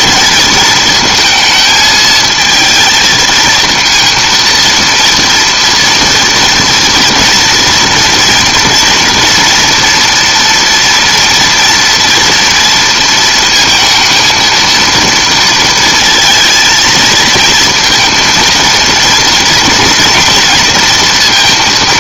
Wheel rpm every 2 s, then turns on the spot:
220, 220, 230, 230, 240, 230, 230, 220, 230, 230, 230.
none